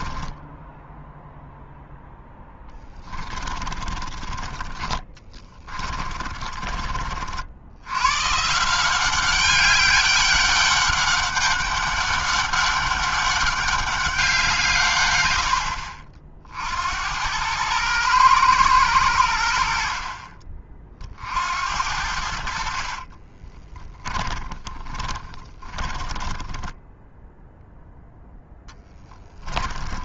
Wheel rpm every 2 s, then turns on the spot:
0, 20, 30, 50, 190, 200, 200, 120, 90, 90, 50, 40, 20, 0, 10.
2-6 22-26 28-30